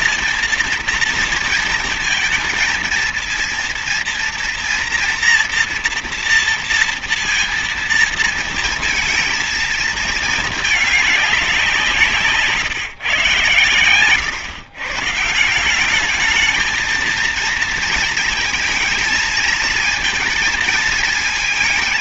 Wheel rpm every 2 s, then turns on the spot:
230, 230, 230, 230, 230, 220, 150, 130, 220, 230, 230.
none